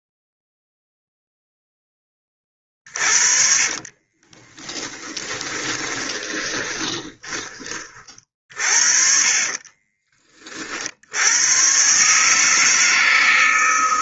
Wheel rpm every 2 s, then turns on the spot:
0, 20, 20, 20, 40, 40, 160.
4-8